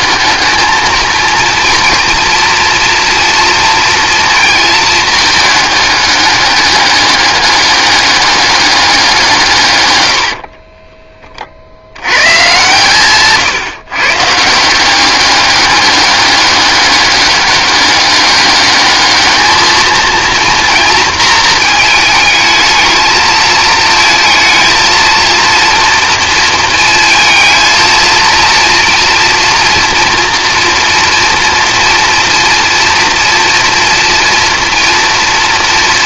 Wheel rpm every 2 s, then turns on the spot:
220, 240, 220, 200, 200, 40, 130, 180, 200, 210, 230, 220, 220, 230, 230, 230, 230, 240.
10-12